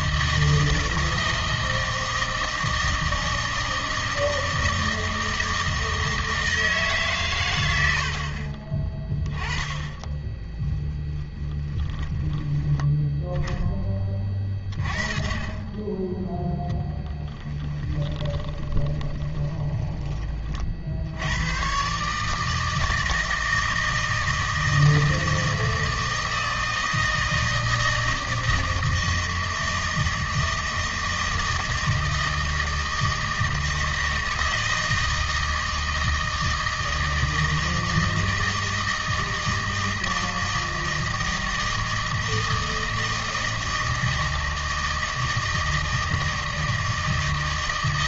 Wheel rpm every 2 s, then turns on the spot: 160, 160, 160, 160, 30, 10, 10, 30, 10, 20, 60, 160, 160, 160, 160, 160, 160, 160, 160, 160, 160, 160, 160, 160.
10-12 16-20